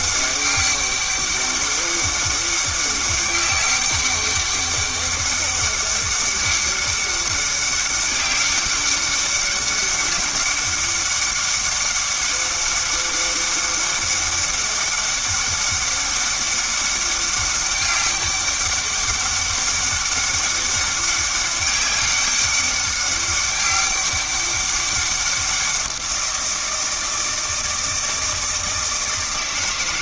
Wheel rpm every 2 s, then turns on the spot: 200, 200, 200, 200, 200, 200, 200, 200, 200, 200, 200, 200, 200, 170, 160.
none